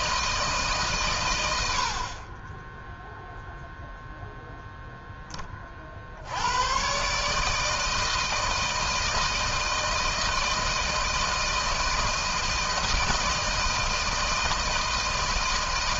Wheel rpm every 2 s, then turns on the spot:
160, 20, 0, 100, 160, 160, 160, 160.
none